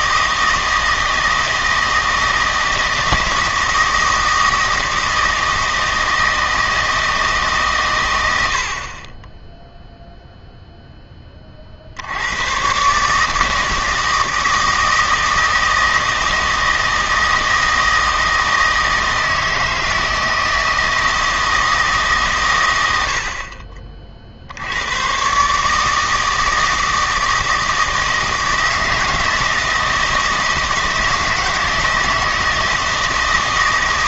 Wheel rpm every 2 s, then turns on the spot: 160, 160, 160, 160, 60, 0, 130, 160, 160, 160, 160, 110, 80, 160, 160, 160, 160.
none